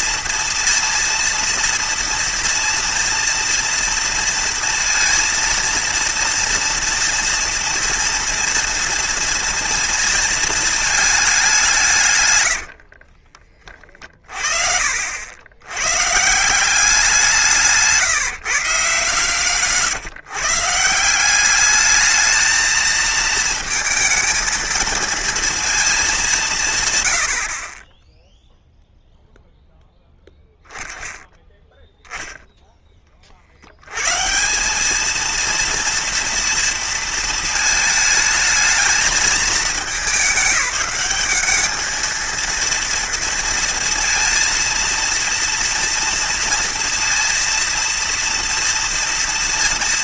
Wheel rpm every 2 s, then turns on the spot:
230, 230, 230, 230, 230, 220, 70, 50, 180, 150, 150, 220, 230, 140, 0, 0, 10, 210, 230, 220, 200, 230, 230, 230, 230.
12-14